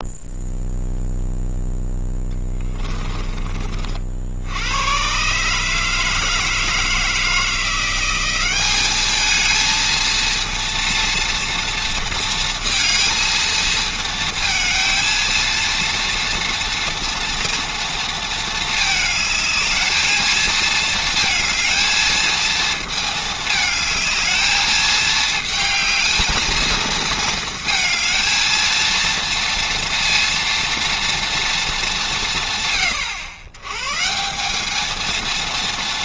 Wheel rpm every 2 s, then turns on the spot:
0, 10, 100, 160, 210, 230, 230, 230, 240, 220, 230, 220, 220, 220, 230, 230, 120, 230.
2-4